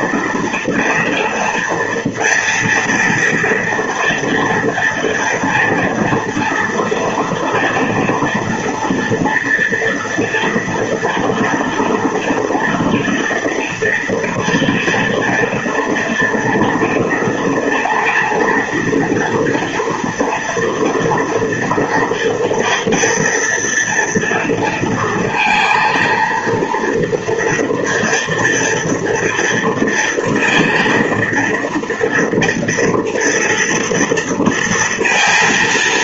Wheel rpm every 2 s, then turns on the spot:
230, 230, 230, 230, 230, 230, 230, 230, 230, 230, 230, 230, 230, 230, 240, 230, 230, 230.
none